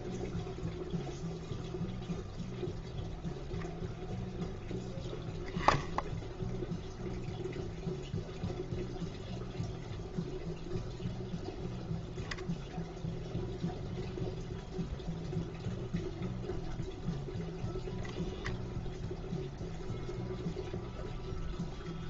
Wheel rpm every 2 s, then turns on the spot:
0, 0, 0, 0, 0, 0, 0, 0, 0, 0, 0.
none